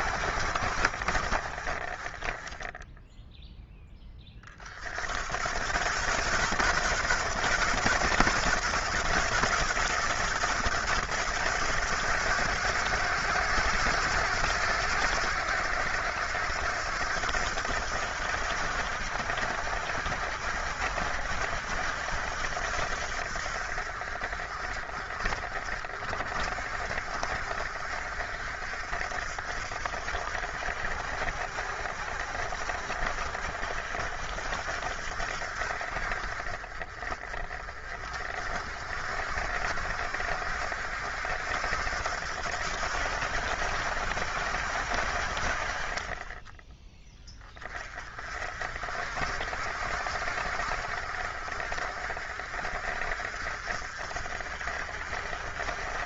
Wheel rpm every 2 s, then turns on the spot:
40, 10, 80, 120, 110, 110, 110, 90, 80, 70, 70, 60, 40, 50, 60, 60, 60, 60, 40, 60, 70, 70, 50, 20, 50, 50, 50, 60.
none